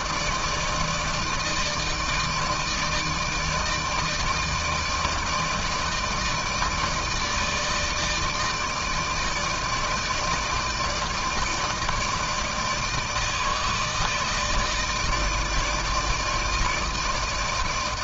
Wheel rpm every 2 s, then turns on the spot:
160, 160, 160, 150, 160, 160, 160, 160, 160.
none